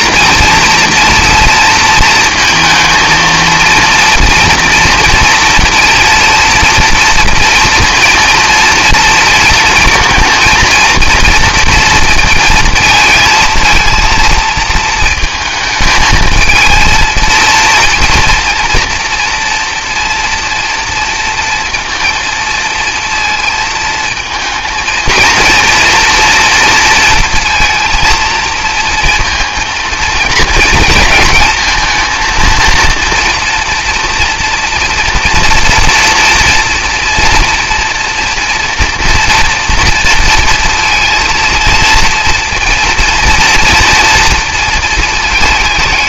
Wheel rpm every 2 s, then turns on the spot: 230, 230, 230, 230, 230, 230, 230, 230, 230, 230, 230, 230, 230, 230, 230, 220, 230, 230, 230, 240, 230, 240, 230.
none